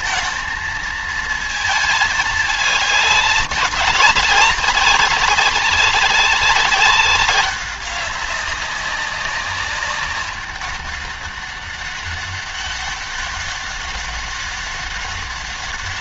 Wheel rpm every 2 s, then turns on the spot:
220, 210, 190, 190, 190, 200, 200, 200.
none